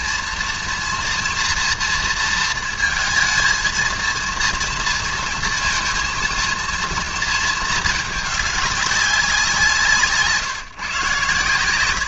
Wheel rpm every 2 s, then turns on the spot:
240, 230, 230, 230, 200, 140.
none